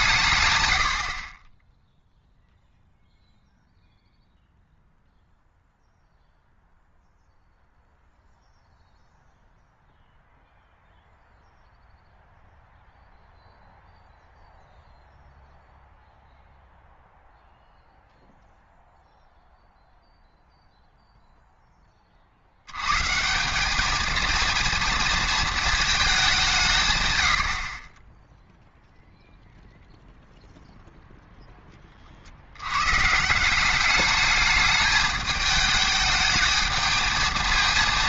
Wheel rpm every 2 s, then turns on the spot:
110, 0, 0, 0, 0, 0, 0, 0, 0, 0, 0, 90, 230, 170, 0, 0, 100, 210, 220.
none